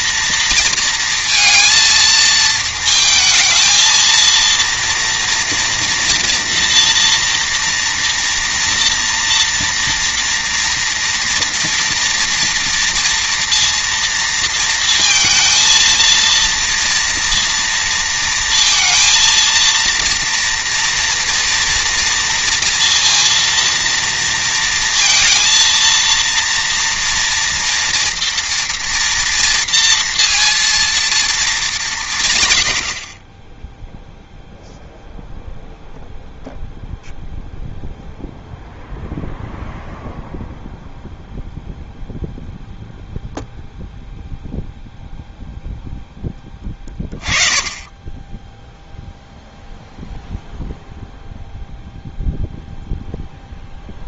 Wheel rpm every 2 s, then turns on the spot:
230, 220, 230, 240, 240, 230, 230, 230, 230, 230, 230, 230, 230, 230, 230, 230, 90, 0, 0, 0, 0, 0, 0, 10, 0, 0, 0.
none